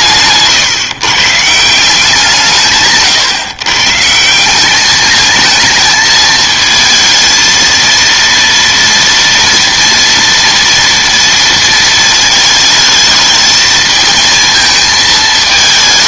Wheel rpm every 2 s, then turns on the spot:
130, 160, 190, 220, 230, 230, 220, 230.
none